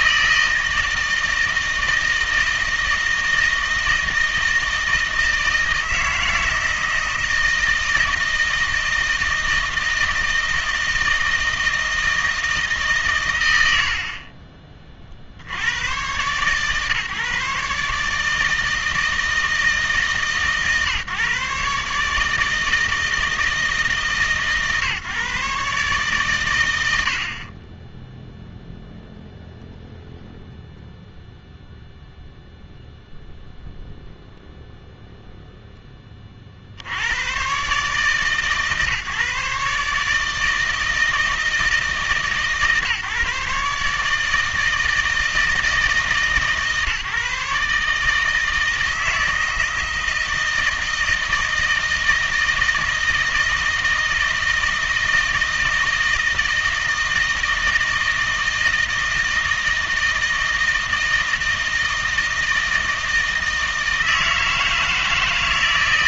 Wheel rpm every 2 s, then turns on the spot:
160, 160, 160, 160, 160, 160, 150, 30, 130, 160, 140, 160, 150, 110, 0, 0, 0, 0, 60, 140, 160, 150, 160, 150, 160, 160, 160, 160, 160, 160, 160, 160, 160.
none